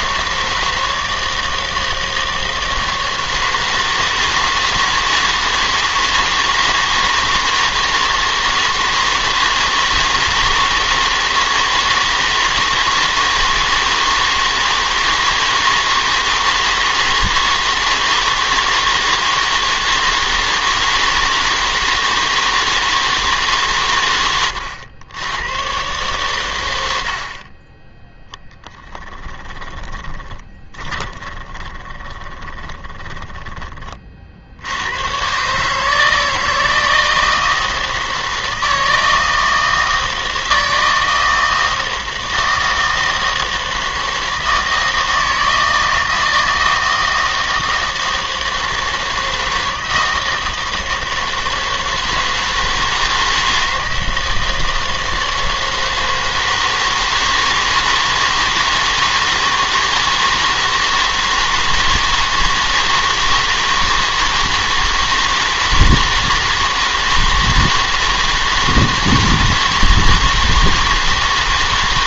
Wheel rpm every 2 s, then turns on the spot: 160, 160, 160, 160, 160, 160, 160, 160, 160, 160, 160, 160, 100, 90, 10, 20, 20, 80, 160, 160, 160, 160, 160, 160, 160, 160, 160, 160, 160, 160, 160, 160, 160, 160, 160, 160.
28-34